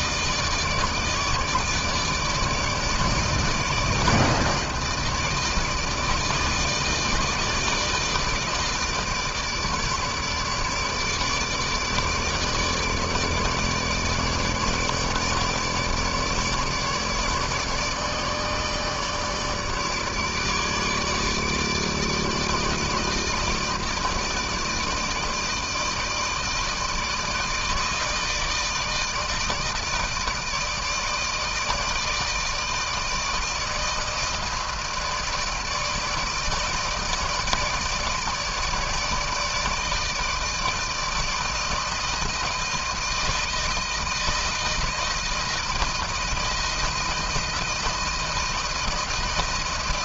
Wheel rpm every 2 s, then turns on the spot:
150, 150, 160, 160, 150, 150, 150, 150, 150, 150, 150, 150, 160, 160, 160, 160, 160, 160, 160, 160, 160, 160, 160, 160, 160.
none